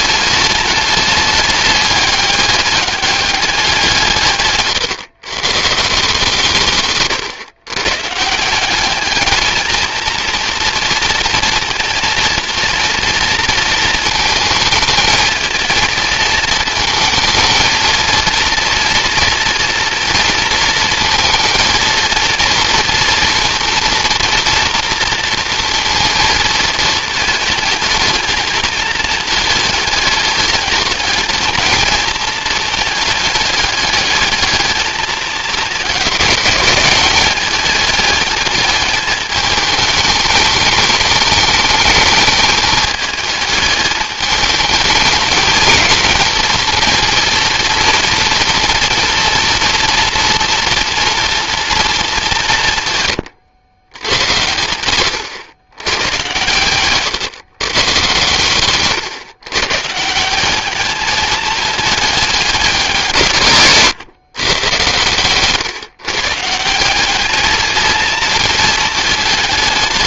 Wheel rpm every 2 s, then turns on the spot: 210, 200, 130, 140, 190, 230, 230, 220, 230, 230, 230, 230, 240, 220, 220, 210, 220, 220, 200, 220, 210, 220, 210, 220, 240, 230, 150, 100, 120, 140, 200, 190, 120, 170, 220.
4-6